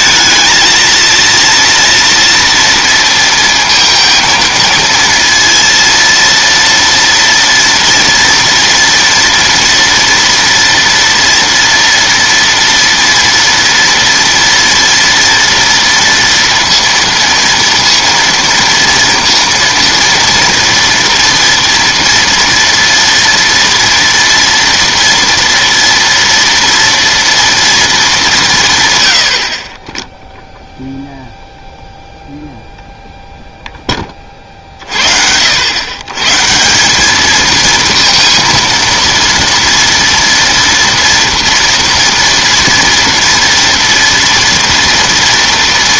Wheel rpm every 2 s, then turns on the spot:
230, 230, 230, 230, 230, 230, 230, 230, 230, 230, 230, 230, 230, 230, 150, 0, 0, 50, 160, 230, 240, 240, 230.
none